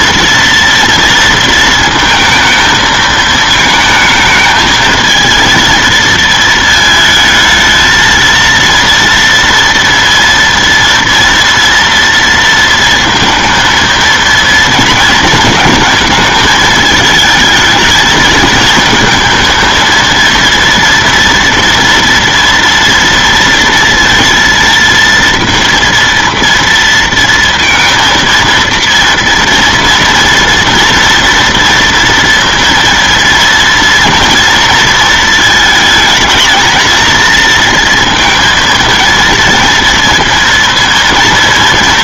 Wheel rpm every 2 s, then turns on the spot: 230, 220, 220, 230, 230, 230, 230, 230, 220, 220, 230, 230, 230, 230, 230, 230, 230, 230, 230, 230, 230.
none